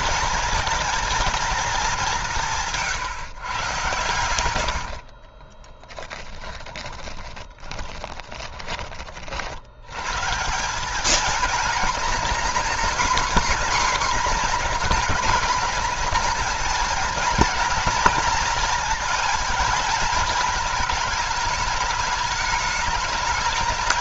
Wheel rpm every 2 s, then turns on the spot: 220, 160, 80, 20, 20, 190, 250, 240, 230, 230, 220, 210.
4-8